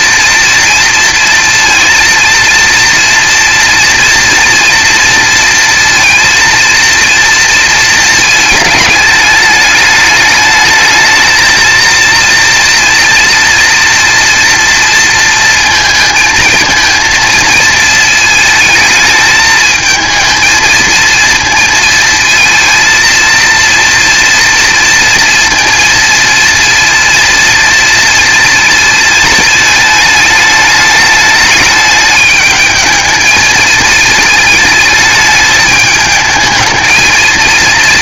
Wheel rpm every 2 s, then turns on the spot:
230, 230, 230, 230, 220, 220, 230, 230, 230, 220, 220, 230, 230, 230, 230, 210, 220, 220, 220.
none